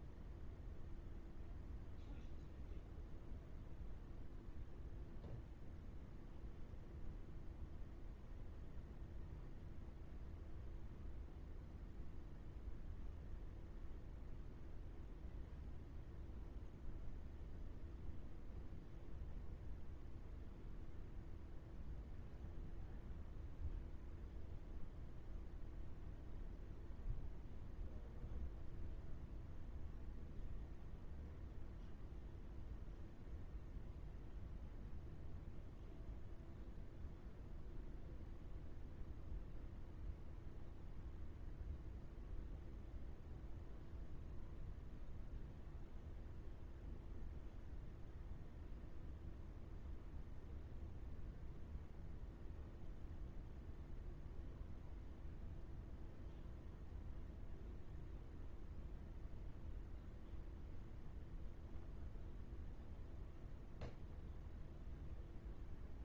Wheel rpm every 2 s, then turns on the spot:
0, 0, 0, 0, 0, 0, 0, 0, 0, 0, 0, 0, 0, 0, 0, 0, 0, 0, 0, 0, 0, 0, 0, 0, 0, 0, 0, 0, 0, 0, 0, 0, 0.
none